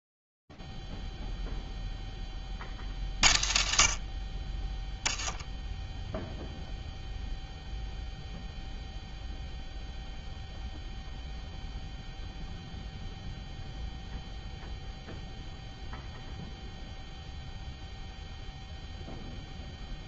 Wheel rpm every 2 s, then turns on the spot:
0, 0, 30, 0, 0, 0, 0, 0, 0, 0.
none